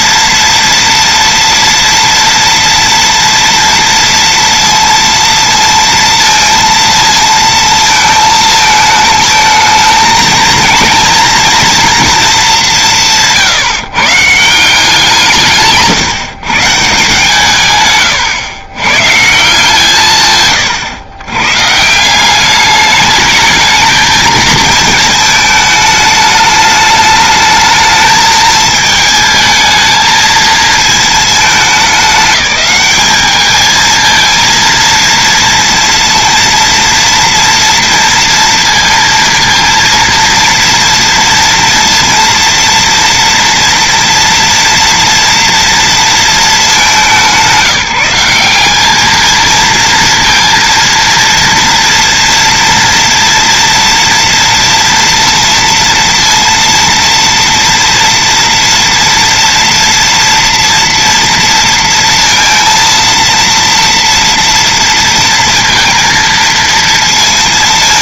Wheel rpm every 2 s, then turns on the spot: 230, 230, 230, 230, 220, 230, 190, 170, 150, 120, 130, 200, 220, 210, 220, 220, 210, 230, 230, 230, 230, 230, 230, 210, 200, 230, 230, 230, 230, 230, 230, 230, 230, 230.
none